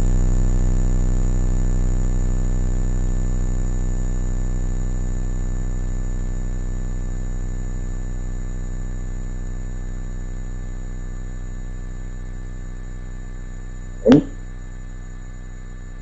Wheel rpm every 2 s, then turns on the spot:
0, 0, 0, 0, 0, 0, 0, 0.
none